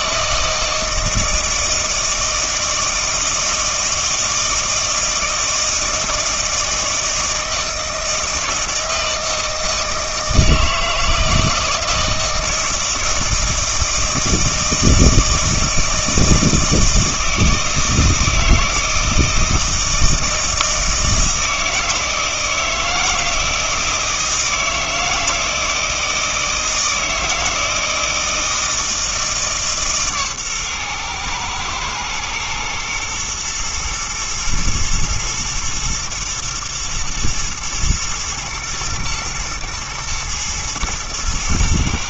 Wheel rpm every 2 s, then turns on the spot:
160, 160, 160, 160, 160, 160, 160, 160, 160, 160, 160, 160, 160, 160, 160, 130, 120, 110, 110, 110, 120.
none